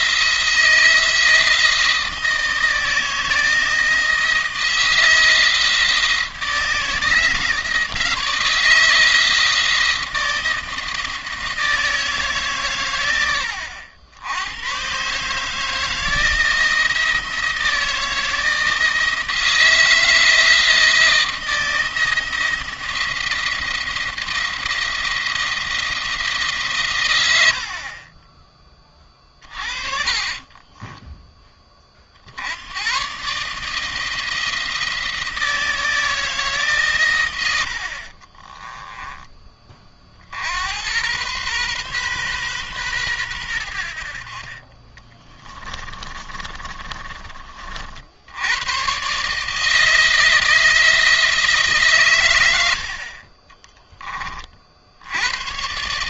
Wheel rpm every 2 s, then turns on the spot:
170, 160, 160, 170, 160, 160, 120, 120, 170, 160, 160, 170, 170, 140, 30, 20, 100, 160, 130, 20, 80, 120, 30, 30, 110, 160, 80, 50.
30-32 38-40 44-48